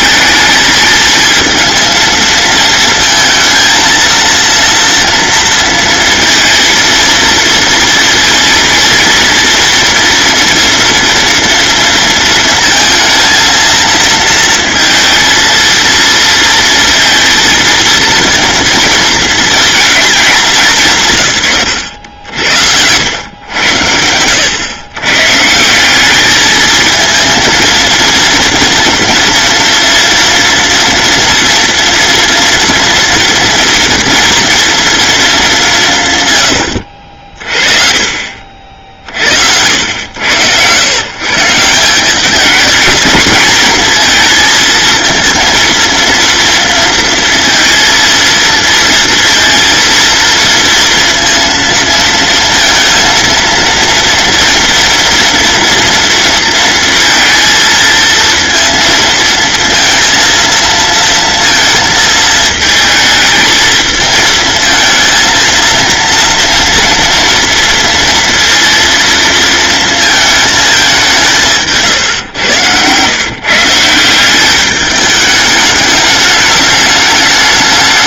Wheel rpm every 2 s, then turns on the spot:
220, 230, 230, 230, 230, 230, 230, 230, 230, 230, 170, 80, 110, 220, 230, 230, 230, 230, 70, 50, 120, 210, 220, 230, 230, 230, 230, 230, 230, 230, 230, 220, 230, 230, 230, 210, 120, 210, 210.
none